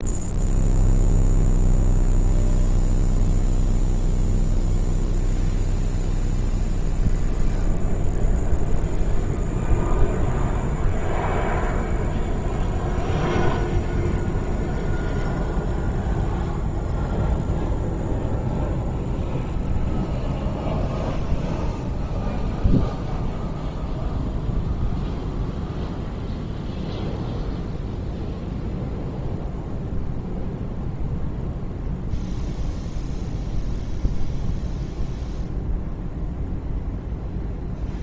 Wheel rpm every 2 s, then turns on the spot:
0, 0, 0, 0, 0, 0, 0, 0, 0, 0, 0, 0, 0, 0, 0, 0, 0, 0, 0.
none